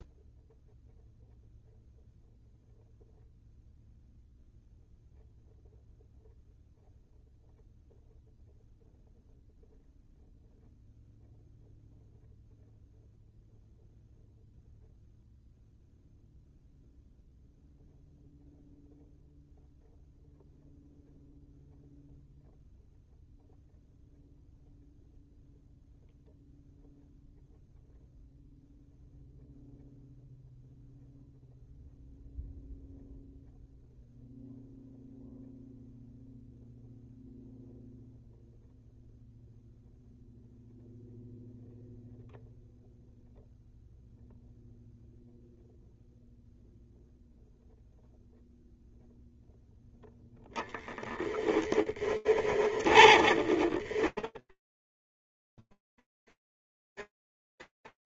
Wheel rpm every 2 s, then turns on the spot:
0, 0, 0, 0, 0, 0, 0, 0, 0, 0, 0, 0, 0, 0, 0, 0, 0, 0, 0, 0, 0, 0, 0, 0, 0, 10, 30, 10, 10.
52-56